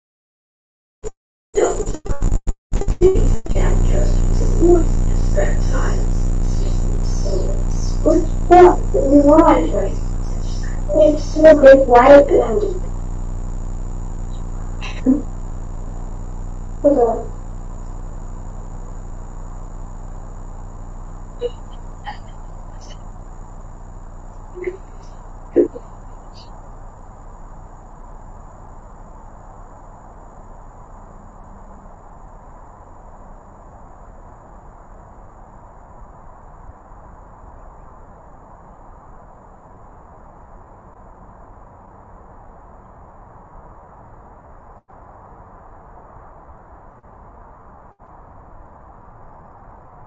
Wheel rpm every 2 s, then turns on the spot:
0, 0, 0, 0, 0, 0, 0, 0, 0, 0, 0, 0, 0, 0, 0, 0, 0, 0, 0, 0, 0, 0, 0, 0, 0.
none